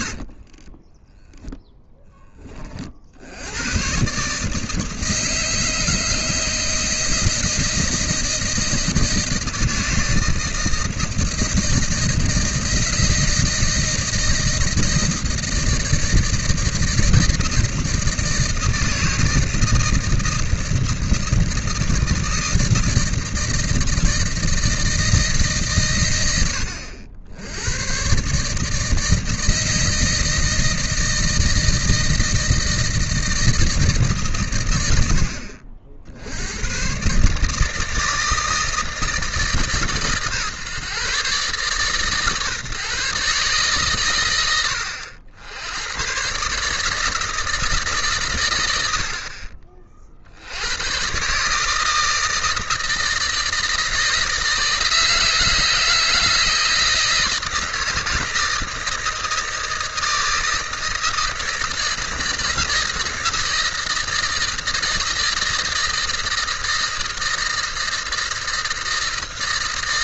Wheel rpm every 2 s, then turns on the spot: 30, 50, 160, 160, 160, 160, 160, 160, 160, 160, 160, 160, 160, 70, 150, 160, 160, 100, 110, 160, 140, 150, 100, 150, 90, 110, 160, 160, 160, 160, 160, 160, 160, 160, 160.
0-2